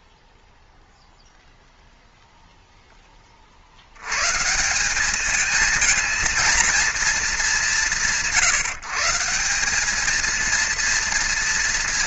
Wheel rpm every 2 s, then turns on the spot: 0, 30, 210, 200, 190, 230.
none